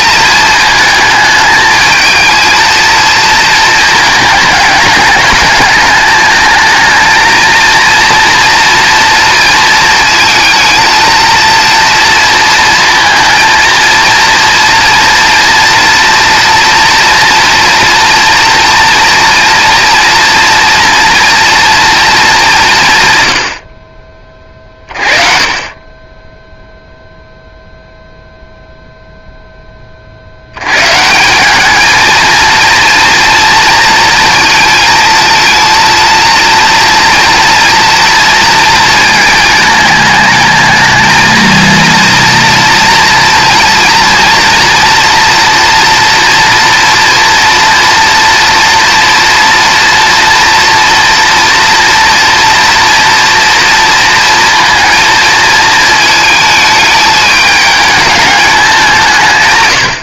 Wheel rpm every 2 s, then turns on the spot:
220, 230, 210, 230, 230, 230, 230, 230, 230, 230, 230, 140, 40, 0, 0, 110, 230, 220, 230, 230, 220, 230, 240, 230, 230, 240, 230, 230, 220, 190.
none